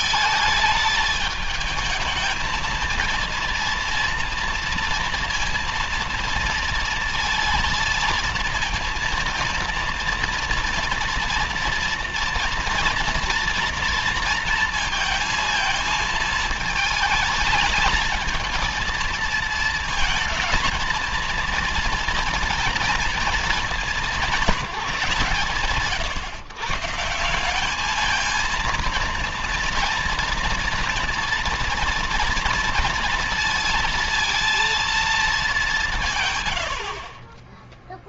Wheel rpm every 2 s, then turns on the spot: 220, 220, 230, 230, 230, 240, 230, 230, 220, 220, 230, 230, 190, 140, 230, 230, 230, 230, 80.
none